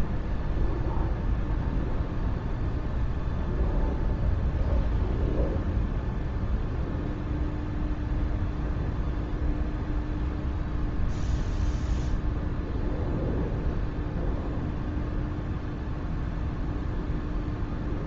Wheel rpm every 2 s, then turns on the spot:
0, 0, 0, 0, 0, 0, 0, 0, 0.
none